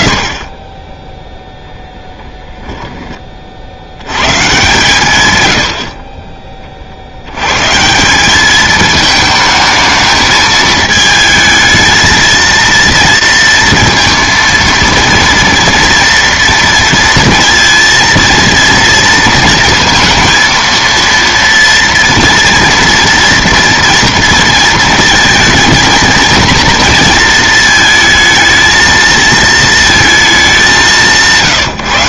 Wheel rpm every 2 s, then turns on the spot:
10, 10, 130, 30, 210, 220, 230, 230, 230, 230, 230, 230, 230, 230, 230, 200.
none